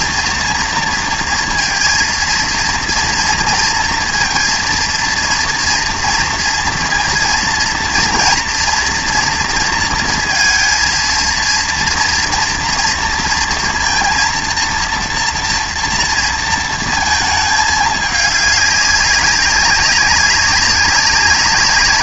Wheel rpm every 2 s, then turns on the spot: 240, 230, 230, 230, 240, 230, 230, 230, 230, 200, 190.
none